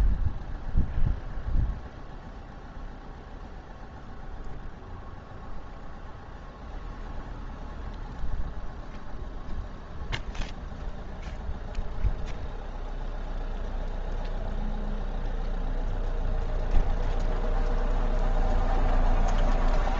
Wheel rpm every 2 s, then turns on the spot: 0, 0, 0, 0, 0, 0, 0, 0, 0, 0.
none